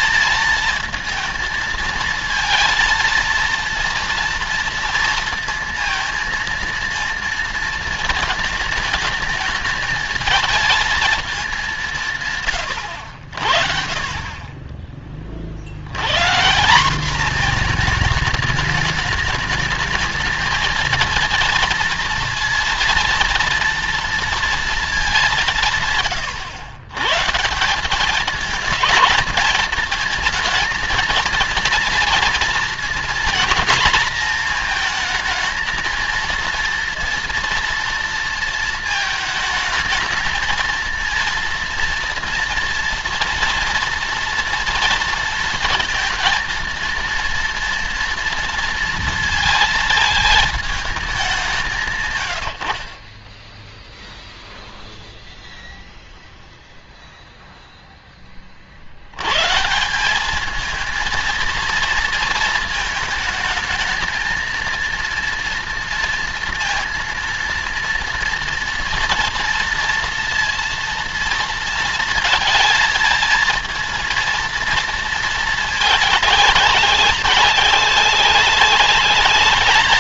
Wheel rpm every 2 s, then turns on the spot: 230, 230, 230, 230, 220, 220, 140, 30, 170, 210, 220, 230, 230, 110, 210, 230, 230, 230, 230, 230, 220, 240, 230, 230, 230, 220, 100, 0, 0, 30, 210, 230, 230, 230, 230, 230, 230, 230, 200, 200.
none